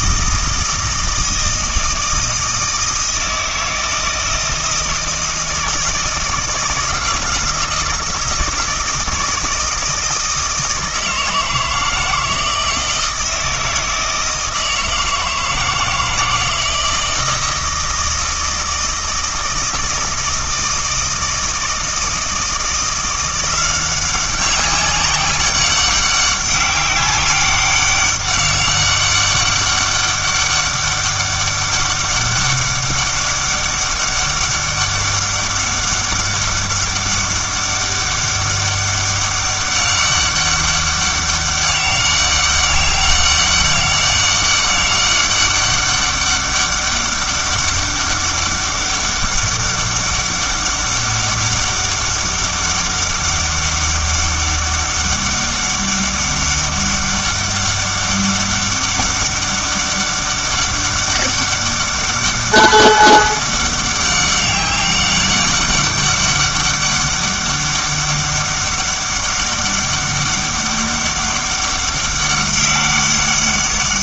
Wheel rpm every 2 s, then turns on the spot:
160, 160, 160, 160, 160, 160, 160, 160, 170, 160, 160, 170, 190, 200, 200, 200, 200, 200, 200, 200, 200, 200, 200, 200, 200, 200, 200, 200, 200, 200, 200, 200, 200, 200, 200, 200, 200.
none